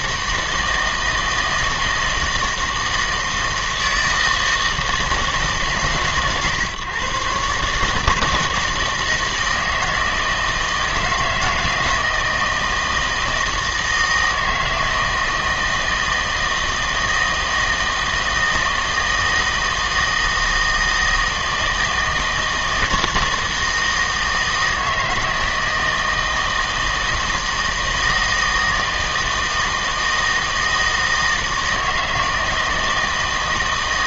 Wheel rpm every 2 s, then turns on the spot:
160, 160, 160, 140, 160, 160, 160, 160, 160, 160, 160, 160, 160, 160, 160, 160, 160.
none